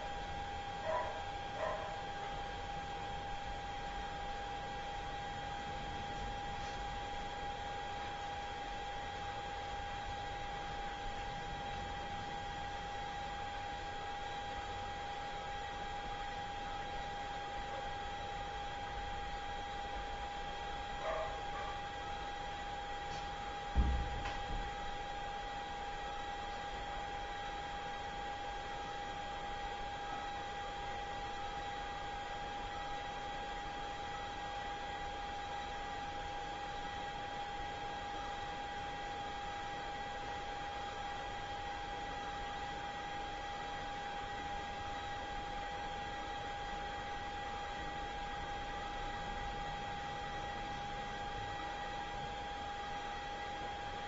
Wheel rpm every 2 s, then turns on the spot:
0, 0, 0, 0, 0, 0, 0, 0, 0, 0, 0, 0, 0, 0, 0, 0, 0, 0, 0, 0, 0, 0, 0, 0, 0, 0, 0.
none